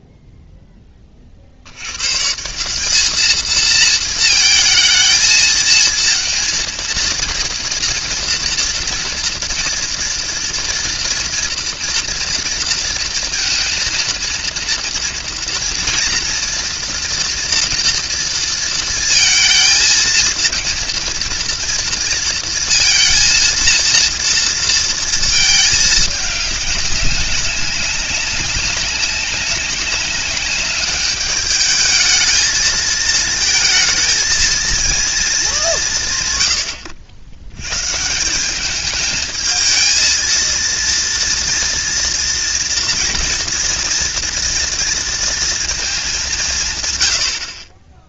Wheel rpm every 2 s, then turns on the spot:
0, 170, 220, 220, 230, 230, 230, 230, 230, 230, 230, 230, 230, 210, 190, 200, 220, 230, 120, 190, 230, 240, 230, 150.
none